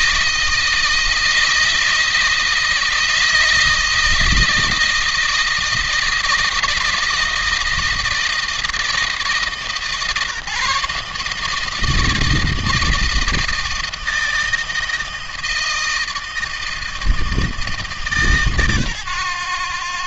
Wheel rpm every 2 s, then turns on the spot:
160, 160, 160, 160, 160, 150, 160, 160, 160, 130.
none